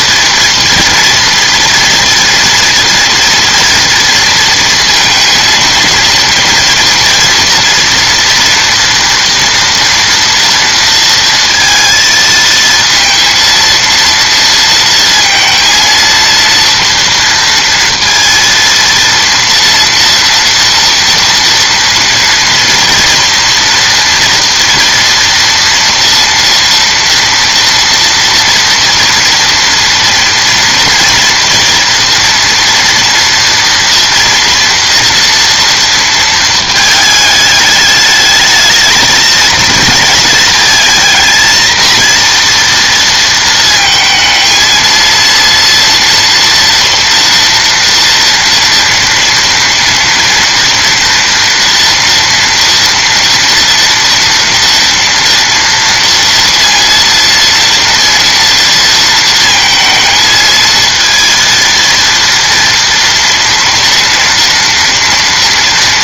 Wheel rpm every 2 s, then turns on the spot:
240, 230, 230, 230, 230, 230, 230, 230, 230, 230, 230, 230, 230, 230, 240, 230, 230, 230, 220, 220, 230, 230, 220, 240, 230, 230, 230, 230, 230, 230, 220, 230, 230.
none